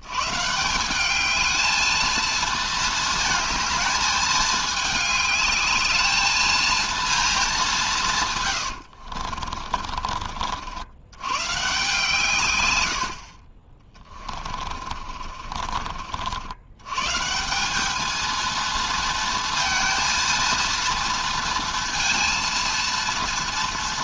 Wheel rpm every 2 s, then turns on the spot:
170, 220, 210, 230, 90, 70, 100, 40, 110, 230, 230, 230.
8-10 14-16